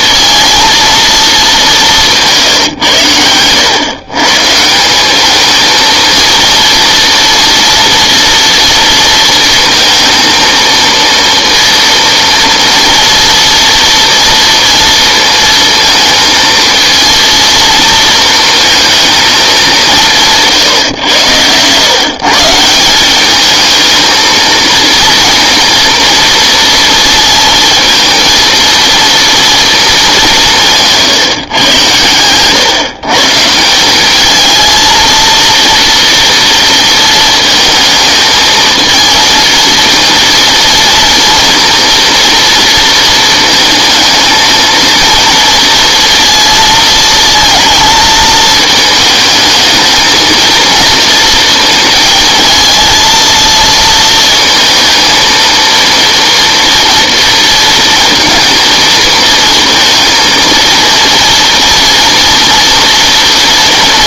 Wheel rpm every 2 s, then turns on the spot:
230, 130, 160, 240, 230, 230, 230, 230, 230, 230, 150, 170, 230, 230, 230, 160, 130, 220, 230, 220, 230, 230, 220, 230, 220, 220, 230, 230, 230, 230, 220, 240.
20-22